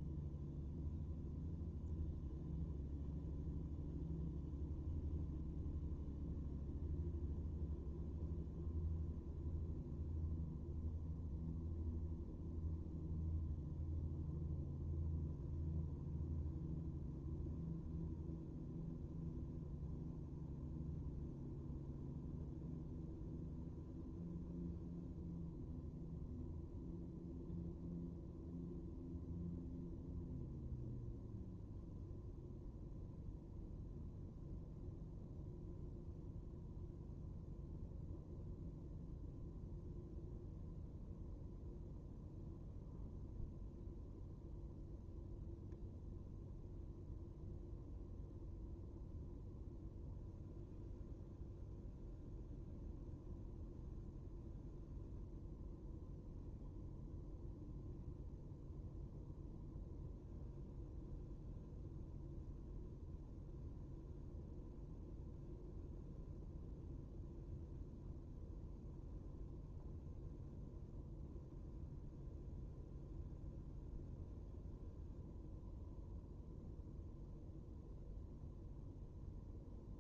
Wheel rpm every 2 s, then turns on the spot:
0, 0, 0, 0, 0, 0, 0, 0, 0, 0, 0, 0, 0, 0, 0, 0, 0, 0, 0, 0, 0, 0, 0, 0, 0, 0, 0, 0, 0, 0, 0, 0, 0, 0, 0, 0, 0, 0, 0, 0.
none